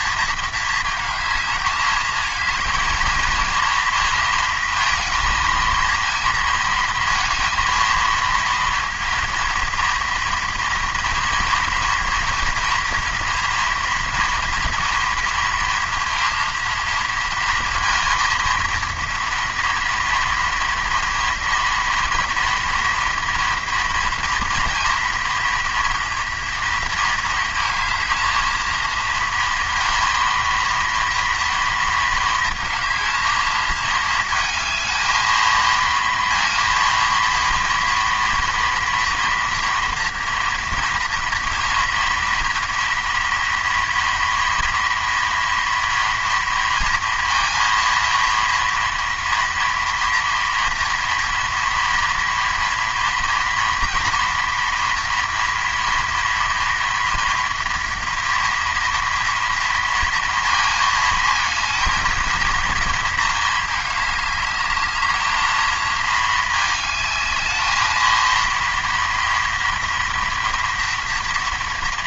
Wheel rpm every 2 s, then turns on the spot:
220, 230, 230, 230, 230, 230, 230, 230, 230, 230, 230, 230, 240, 230, 230, 230, 230, 220, 230, 230, 230, 230, 230, 230, 230, 240, 230, 230, 230, 230, 220, 230, 210, 210, 230, 230.
none